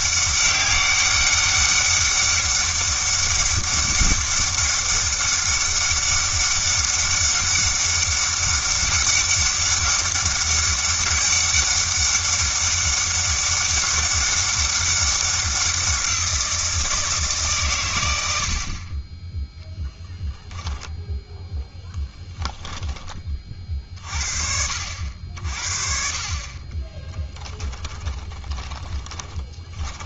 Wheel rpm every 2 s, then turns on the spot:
200, 200, 200, 200, 200, 200, 200, 200, 170, 40, 0, 10, 70, 30, 20.
26-30